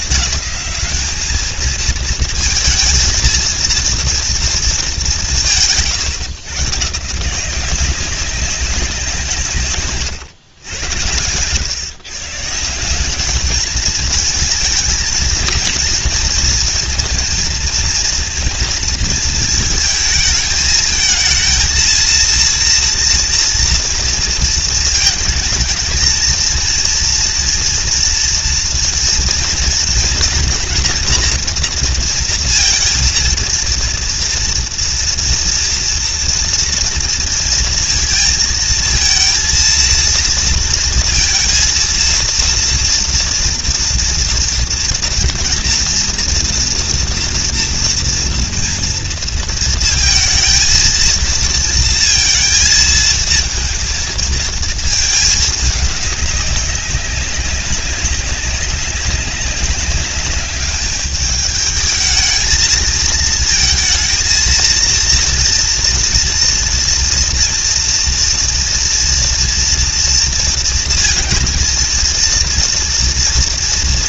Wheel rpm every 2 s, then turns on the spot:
190, 220, 210, 150, 180, 100, 170, 220, 230, 230, 220, 230, 230, 230, 240, 230, 230, 230, 230, 230, 230, 230, 230, 230, 230, 230, 230, 220, 200, 200, 200, 220, 230, 230, 230, 230, 230.
none